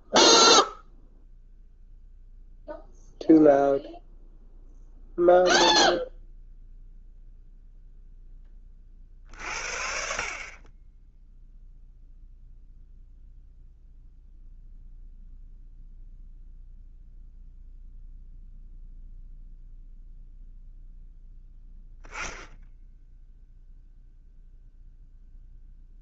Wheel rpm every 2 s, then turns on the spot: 0, 0, 0, 0, 40, 20, 0, 0, 0, 0, 0, 10, 0.
none